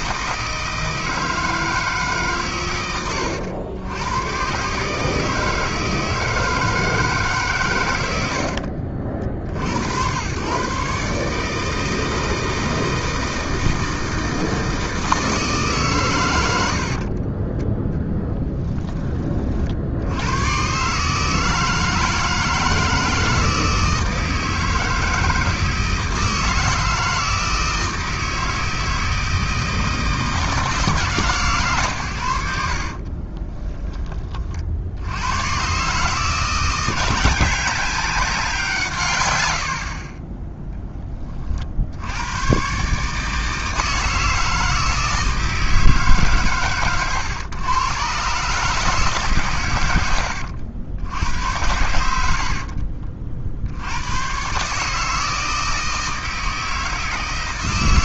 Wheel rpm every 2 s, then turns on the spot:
160, 120, 130, 160, 60, 130, 160, 160, 80, 10, 130, 160, 160, 160, 160, 160, 80, 50, 170, 150, 10, 120, 160, 130, 150, 80, 50, 140, 160.
8-10 16-20 32-34 52-54